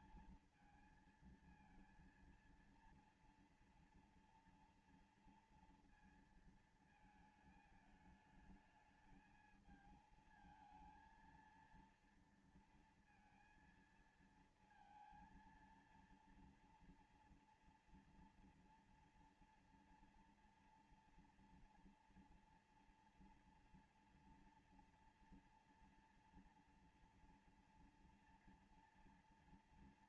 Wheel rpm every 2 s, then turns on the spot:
220, 230, 240, 230, 220, 220, 230, 230, 230, 230, 230, 230, 230, 240, 230.
none